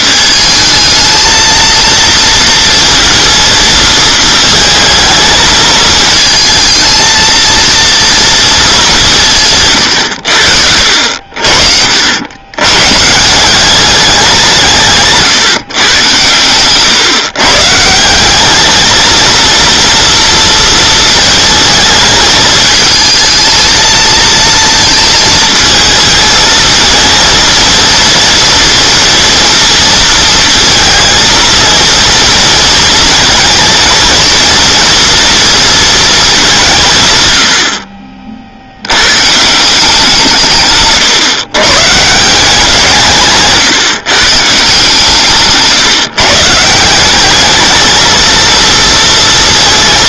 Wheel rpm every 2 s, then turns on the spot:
220, 230, 220, 220, 190, 70, 130, 150, 120, 210, 230, 220, 230, 230, 230, 230, 230, 230, 170, 70, 140, 170, 150, 160, 230.
40-42